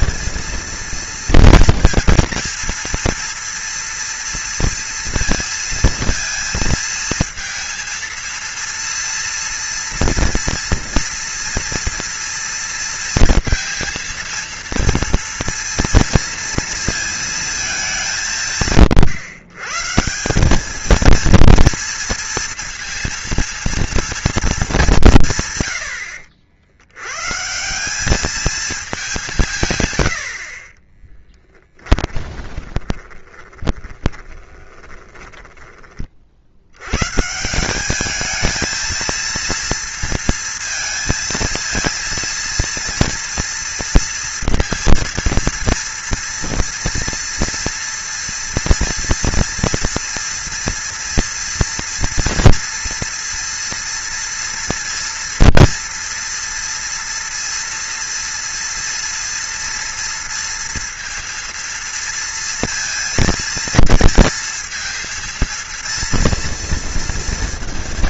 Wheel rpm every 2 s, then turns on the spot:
230, 230, 230, 230, 230, 230, 230, 230, 230, 150, 210, 230, 210, 70, 220, 40, 20, 20, 80, 220, 230, 230, 230, 240, 240, 230, 230, 230, 230, 240, 230, 230, 230, 230.
32-36